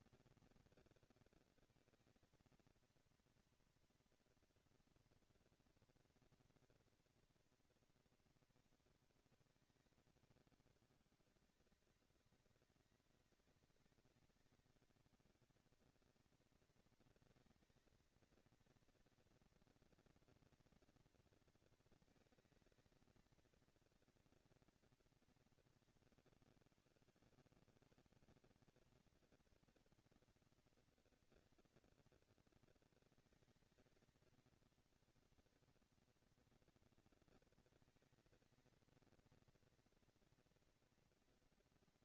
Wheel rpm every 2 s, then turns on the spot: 230, 230, 230, 230, 220, 200, 200, 200, 220, 230, 230, 220, 230, 130, 190, 230, 220, 220, 230, 230, 230.
none